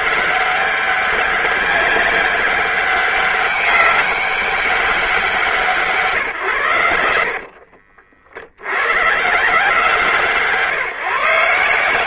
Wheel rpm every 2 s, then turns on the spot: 200, 200, 190, 100, 90, 160.
none